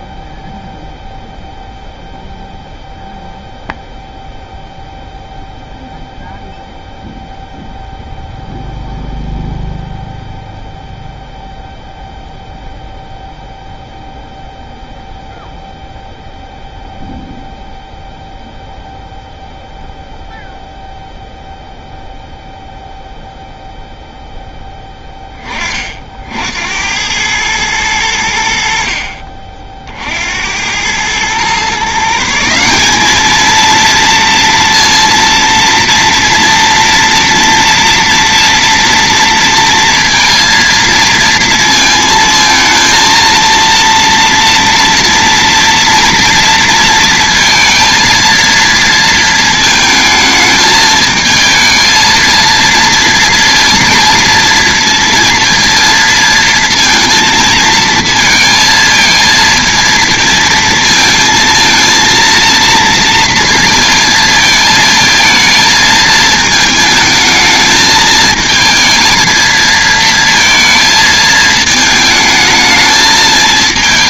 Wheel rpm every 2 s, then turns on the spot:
0, 0, 0, 0, 0, 0, 0, 0, 0, 0, 0, 0, 10, 70, 60, 80, 180, 230, 230, 230, 230, 230, 230, 230, 230, 220, 230, 230, 230, 230, 230, 230, 220, 220, 220, 230, 220.
none